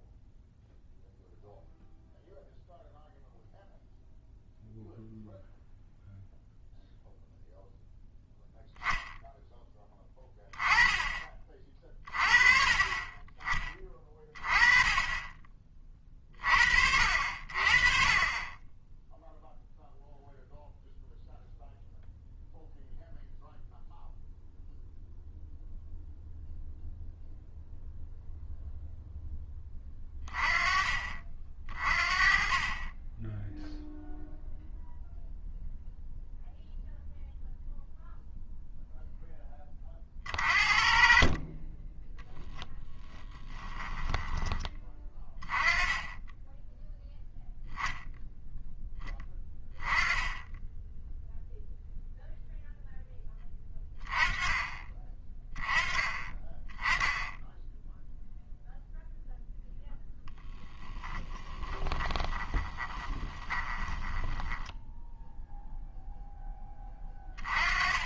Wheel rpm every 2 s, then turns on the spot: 0, 0, 0, 0, 0, 20, 30, 30, 50, 20, 0, 0, 0, 0, 0, 30, 30, 0, 0, 0, 40, 20, 20, 10, 10, 10, 0, 20, 20, 0, 10, 20, 10, 10.
42-44 60-66